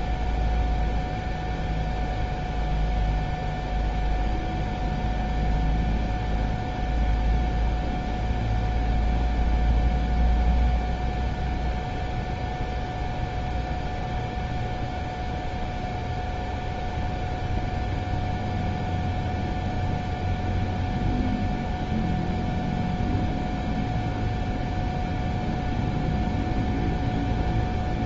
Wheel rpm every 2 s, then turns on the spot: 0, 0, 0, 0, 0, 0, 0, 0, 0, 0, 0, 0, 0, 0.
none